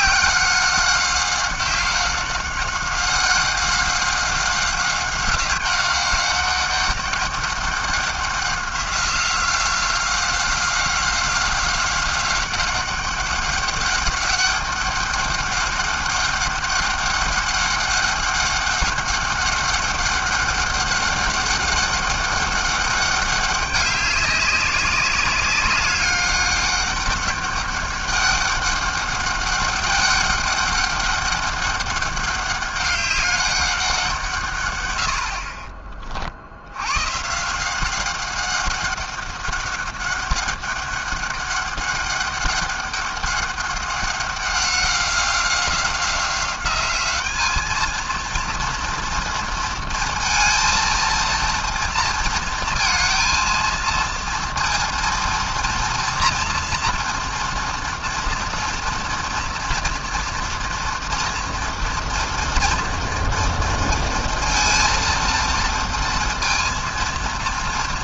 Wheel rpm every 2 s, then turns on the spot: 190, 190, 190, 200, 180, 190, 190, 200, 200, 200, 200, 190, 200, 200, 200, 200, 200, 120, 110, 190, 200, 200, 190, 200, 230, 230, 230, 230, 230, 230, 230, 230, 230, 230.
none